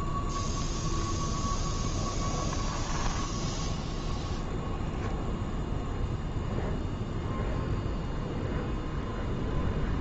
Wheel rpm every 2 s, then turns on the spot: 0, 10, 0, 0, 0.
none